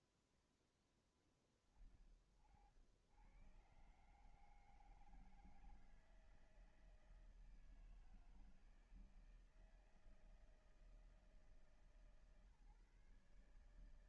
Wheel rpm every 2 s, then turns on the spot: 20, 90, 160, 160, 160, 160, 150.
none